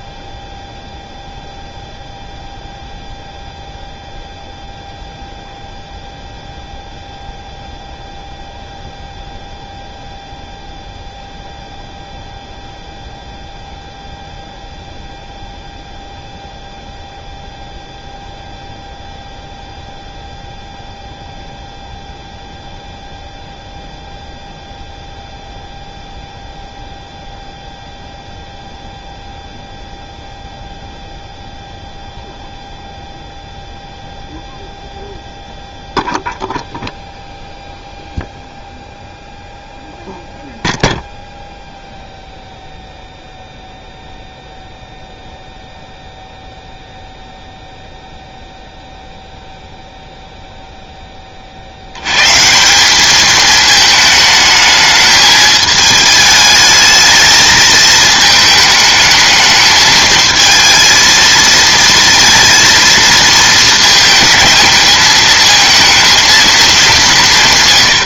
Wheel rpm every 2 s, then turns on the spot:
0, 0, 0, 0, 0, 0, 0, 0, 0, 0, 0, 0, 0, 0, 0, 0, 0, 0, 0, 0, 0, 0, 0, 0, 0, 0, 180, 220, 210, 220, 220, 230, 220, 200.
none